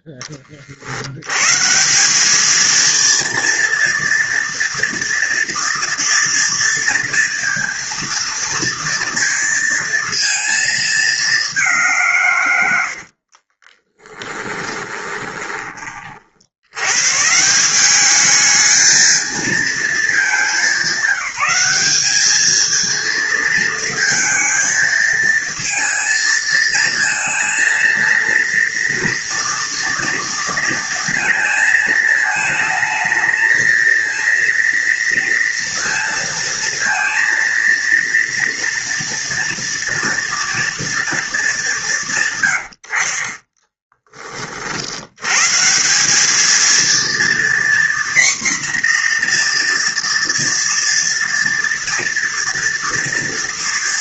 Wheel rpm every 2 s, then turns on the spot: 40, 210, 230, 230, 230, 230, 110, 20, 80, 210, 200, 220, 220, 220, 230, 230, 220, 230, 230, 230, 230, 110, 40, 220, 250, 230, 230.
14-16